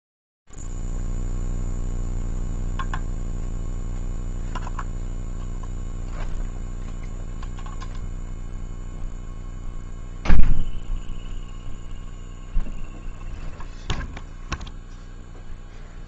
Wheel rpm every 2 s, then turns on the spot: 0, 0, 0, 0, 0, 0, 0, 0.
none